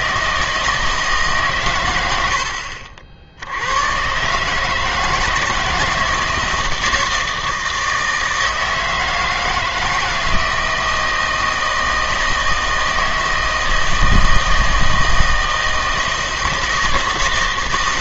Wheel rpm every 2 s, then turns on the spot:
160, 70, 150, 160, 160, 160, 160, 160, 160.
2-4